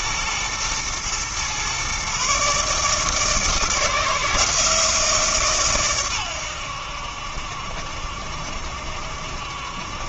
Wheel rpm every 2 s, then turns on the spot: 120, 150, 160, 80, 70.
none